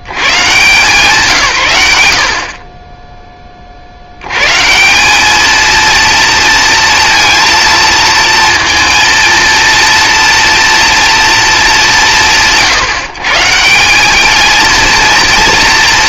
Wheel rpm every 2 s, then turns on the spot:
120, 30, 150, 230, 230, 240, 130, 230.
none